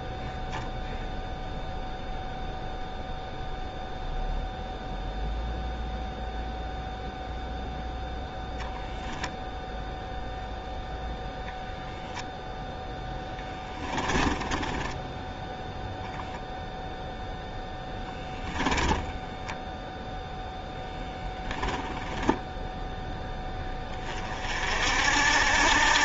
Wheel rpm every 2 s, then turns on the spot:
0, 0, 0, 0, 0, 0, 10, 10, 0, 10, 10, 10, 60.
12-16